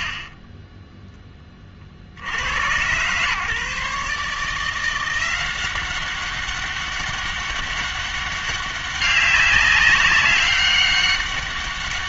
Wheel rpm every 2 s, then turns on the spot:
30, 110, 160, 200, 200, 200.
0-2